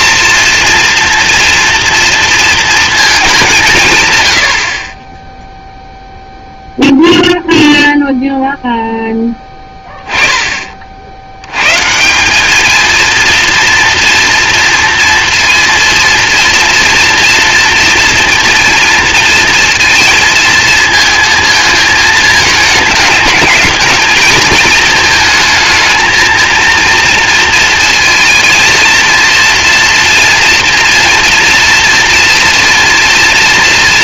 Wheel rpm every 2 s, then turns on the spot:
230, 230, 50, 10, 0, 40, 220, 230, 230, 230, 220, 220, 220, 230, 230, 230, 230.
none